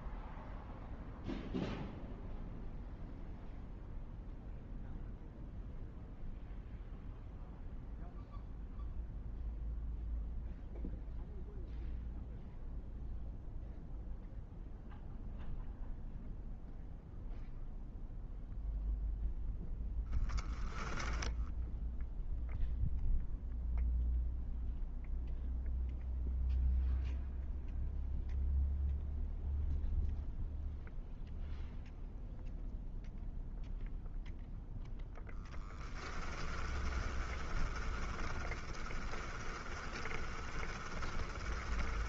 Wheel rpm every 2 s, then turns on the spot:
0, 0, 0, 0, 0, 0, 0, 0, 0, 0, 0, 0, 0, 0, 0, 0, 0, 0, 10, 20, 20.
36-42